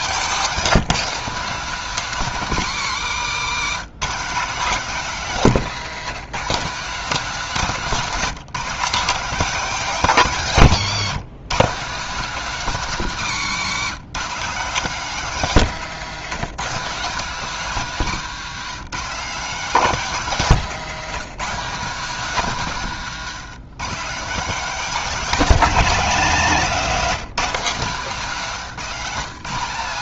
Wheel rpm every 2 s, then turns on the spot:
240, 210, 210, 230, 250, 190, 230, 230, 210, 210, 190, 180, 250, 220, 190.
10-12